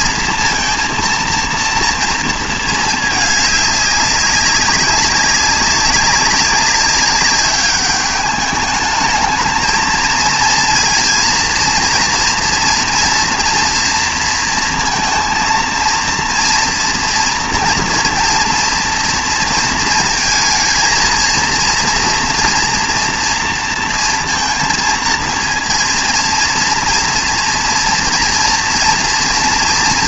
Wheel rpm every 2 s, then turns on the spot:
230, 230, 190, 190, 210, 230, 230, 230, 230, 240, 220, 230, 230, 230, 230.
none